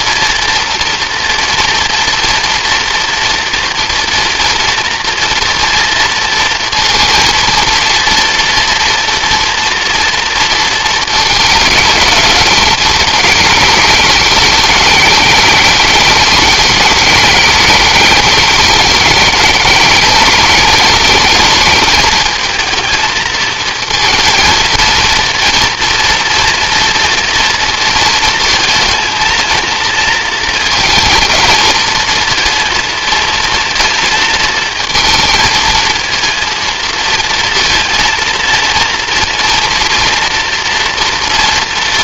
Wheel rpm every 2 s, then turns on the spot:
230, 230, 240, 230, 230, 220, 210, 210, 210, 210, 220, 220, 230, 230, 230, 220, 230, 220, 230, 230, 230.
none